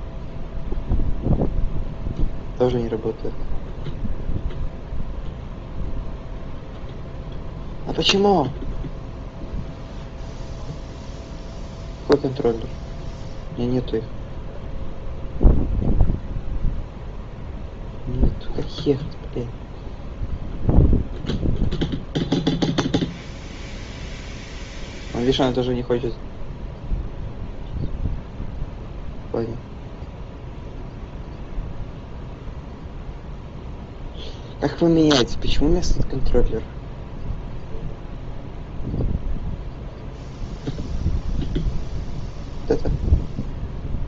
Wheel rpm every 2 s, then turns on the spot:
0, 0, 0, 0, 0, 0, 0, 0, 0, 0, 0, 0, 0, 0, 0, 0, 0, 0, 0, 0, 0, 0.
none